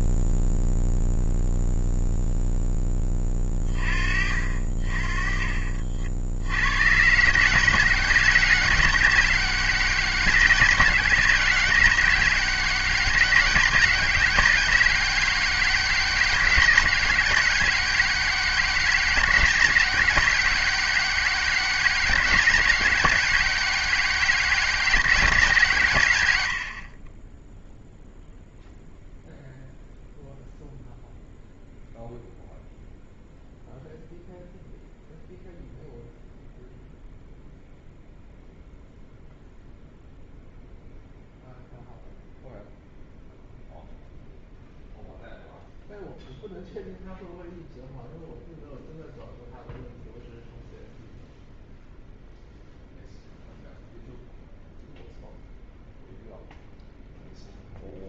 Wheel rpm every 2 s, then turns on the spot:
0, 0, 40, 80, 120, 120, 110, 120, 110, 120, 120, 110, 110, 30, 0, 0, 0, 0, 0, 0, 0, 0, 0, 0, 0, 0, 0, 0, 0.
none